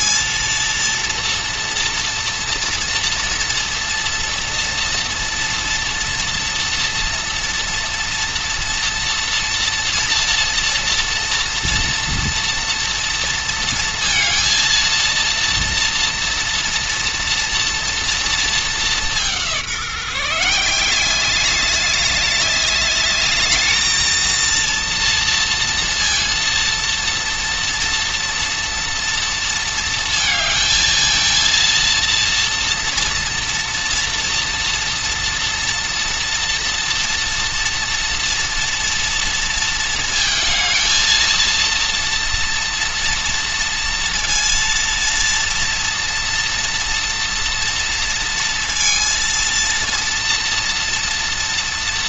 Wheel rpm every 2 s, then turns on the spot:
230, 230, 230, 240, 240, 230, 230, 230, 230, 210, 180, 200, 230, 230, 230, 220, 230, 230, 230, 230, 220, 230, 230, 230, 230, 230.
none